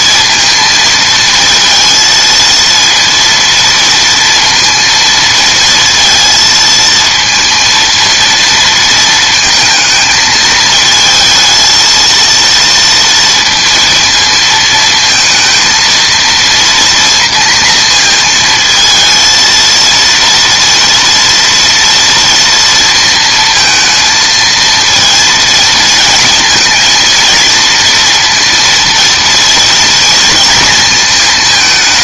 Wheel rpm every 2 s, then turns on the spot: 230, 230, 230, 230, 220, 220, 230, 220, 230, 220, 230, 230, 230, 220, 230, 230.
none